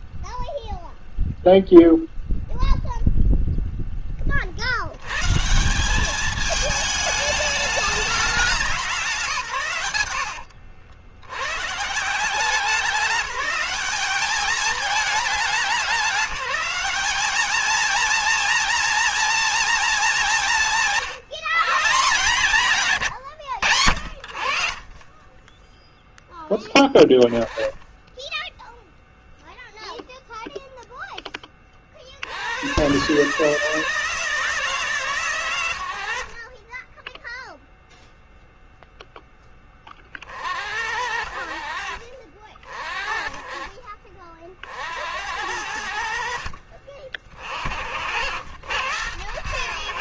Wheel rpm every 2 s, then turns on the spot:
0, 0, 80, 210, 190, 80, 190, 210, 200, 230, 170, 150, 40, 10, 0, 0, 110, 140, 10, 0, 60, 40, 60, 50, 90.
none